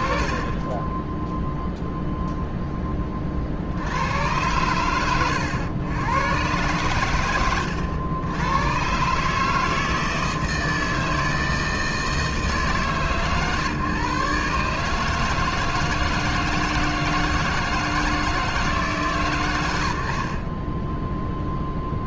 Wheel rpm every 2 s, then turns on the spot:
70, 0, 100, 110, 100, 160, 160, 140, 160, 150, 20.
none